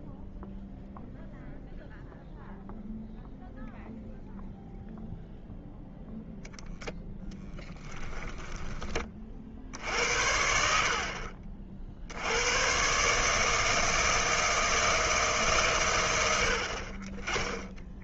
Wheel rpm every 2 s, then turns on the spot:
0, 0, 0, 0, 20, 60, 110, 160, 60.
none